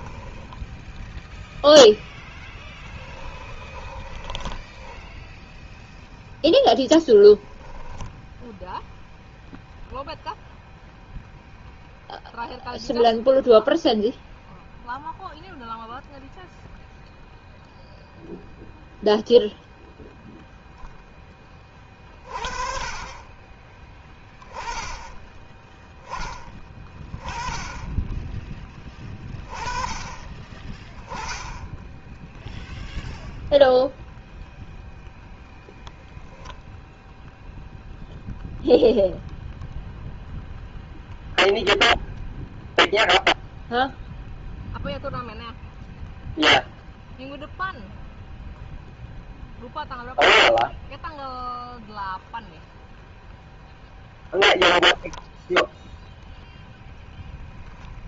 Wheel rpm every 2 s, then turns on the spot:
0, 10, 10, 0, 0, 0, 0, 0, 0, 0, 0, 40, 10, 20, 20, 10, 0, 0, 10, 0, 0, 0, 0, 0, 0, 0, 0, 0, 0.
2-6